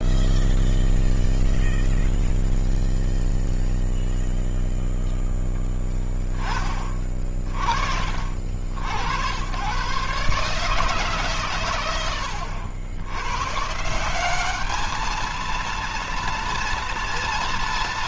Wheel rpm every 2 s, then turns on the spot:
0, 0, 0, 20, 60, 140, 80, 210, 230.
none